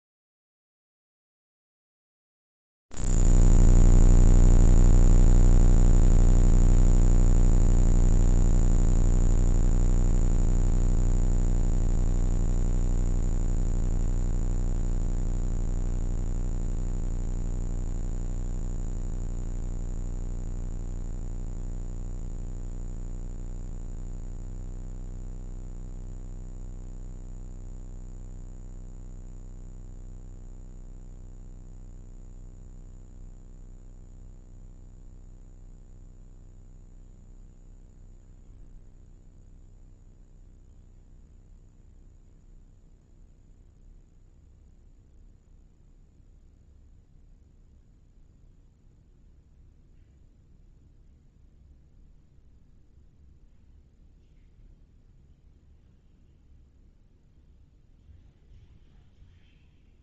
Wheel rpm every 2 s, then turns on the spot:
0, 0, 0, 0, 0, 0, 0, 0, 0, 0, 0, 0, 0, 0, 0, 0, 0, 0, 0, 0, 0, 0, 0, 0, 0, 0, 0, 0, 0, 0.
none